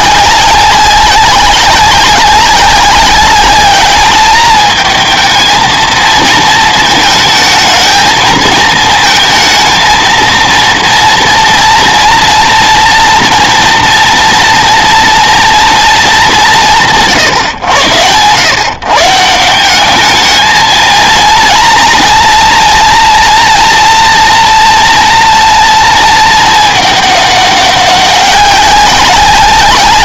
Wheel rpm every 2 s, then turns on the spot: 190, 200, 220, 220, 220, 230, 230, 230, 140, 130, 220, 230, 240, 220, 190.
none